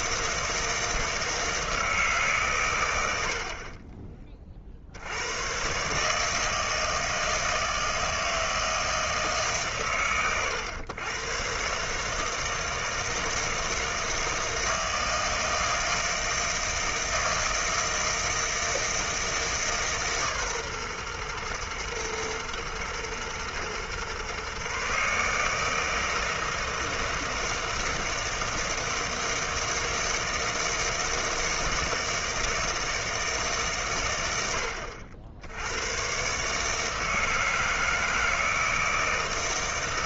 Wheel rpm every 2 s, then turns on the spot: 160, 110, 60, 160, 160, 100, 160, 160, 160, 160, 130, 120, 130, 160, 160, 160, 160, 70, 150, 160.
none